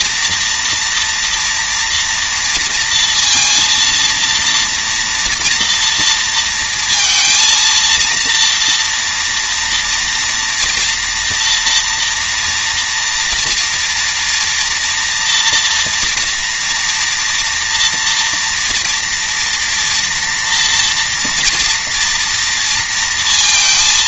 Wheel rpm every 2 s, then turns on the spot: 230, 240, 230, 230, 230, 230, 230, 230, 240, 230, 230, 230.
none